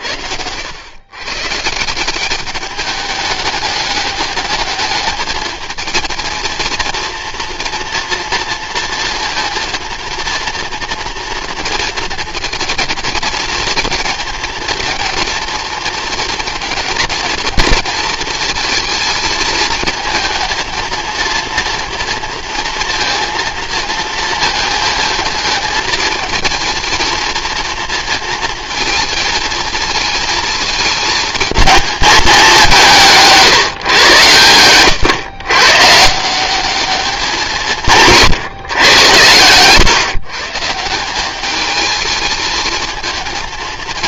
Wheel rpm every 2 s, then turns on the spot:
100, 200, 210, 230, 230, 230, 220, 230, 220, 220, 230, 230, 220, 230, 220, 220, 200, 110, 200, 130, 160, 220.
34-36